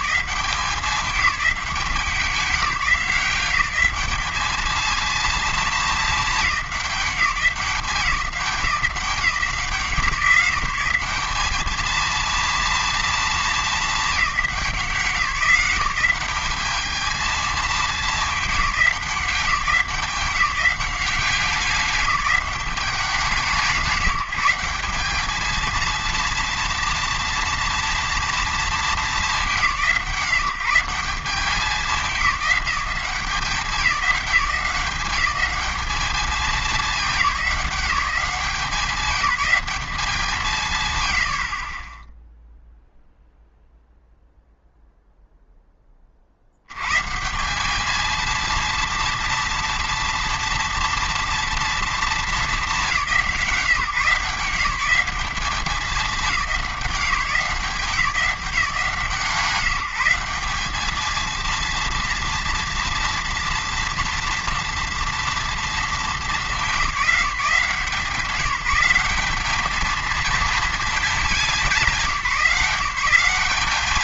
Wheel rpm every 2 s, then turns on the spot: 200, 180, 220, 200, 180, 190, 230, 180, 210, 190, 190, 200, 180, 230, 220, 180, 180, 180, 200, 200, 130, 0, 0, 100, 230, 230, 200, 180, 190, 180, 210, 230, 230, 190, 180, 220, 180.
none